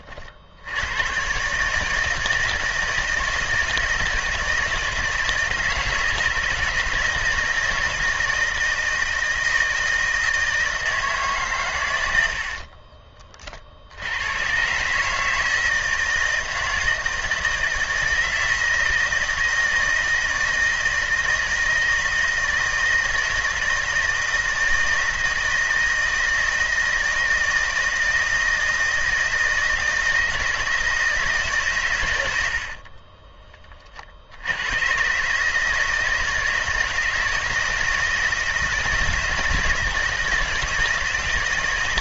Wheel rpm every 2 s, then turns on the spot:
80, 160, 160, 160, 160, 160, 50, 130, 160, 160, 160, 160, 160, 160, 160, 160, 60, 100, 160, 160, 160.
12-14 32-34